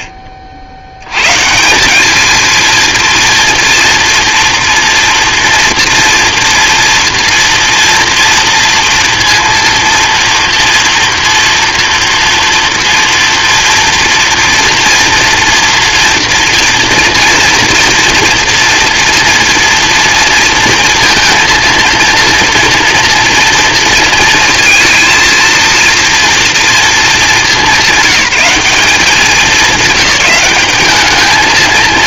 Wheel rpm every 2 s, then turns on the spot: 90, 210, 230, 230, 230, 230, 230, 230, 230, 230, 230, 230, 230, 230, 190, 190.
none